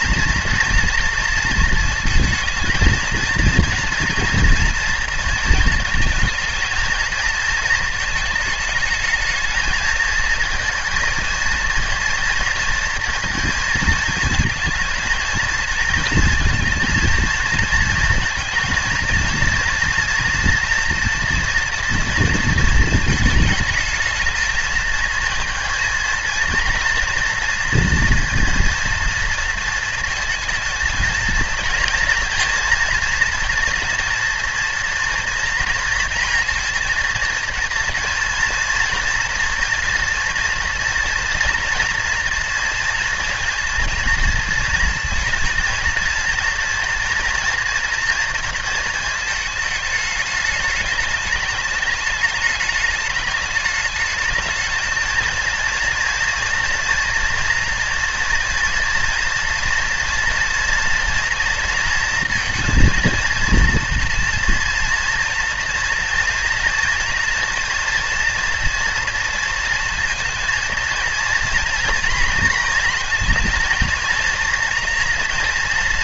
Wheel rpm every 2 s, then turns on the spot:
230, 230, 230, 230, 220, 230, 230, 230, 230, 230, 230, 230, 220, 230, 230, 230, 230, 230, 230, 240, 240, 230, 230, 240, 230, 210, 210, 220, 240, 240, 230, 230, 230, 230, 230, 230, 230, 230.
none